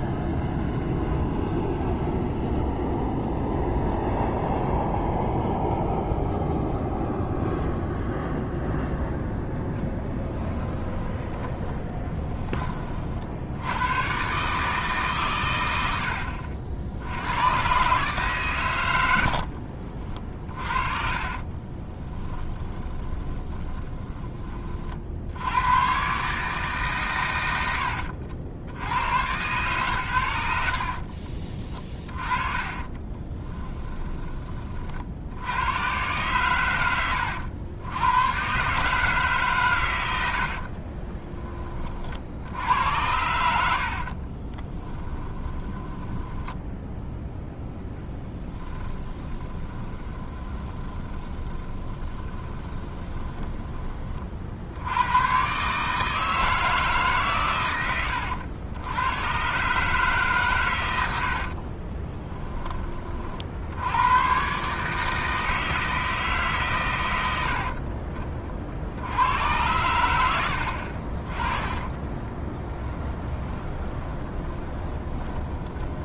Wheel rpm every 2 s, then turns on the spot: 0, 0, 0, 0, 0, 10, 20, 150, 60, 120, 30, 10, 40, 150, 90, 70, 30, 40, 100, 130, 40, 80, 20, 10, 20, 20, 20, 70, 160, 90, 130, 20, 150, 130, 40, 70, 10, 20.
10-12 20-24 30-34 40-42 44-54 72-76